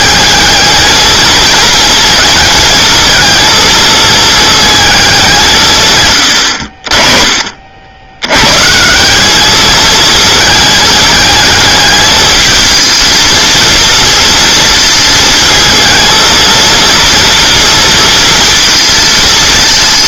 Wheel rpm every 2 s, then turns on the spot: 220, 220, 220, 50, 160, 210, 220, 230, 230, 230.
none